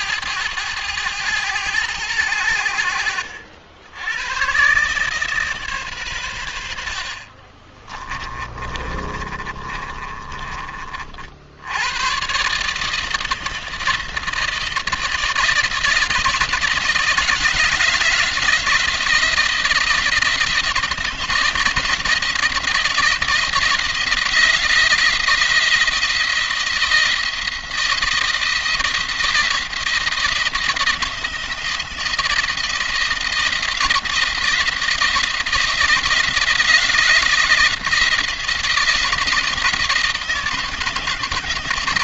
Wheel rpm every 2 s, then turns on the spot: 110, 80, 130, 70, 40, 40, 150, 160, 160, 160, 170, 170, 170, 170, 170, 170, 170, 160, 170, 170, 170.
8-10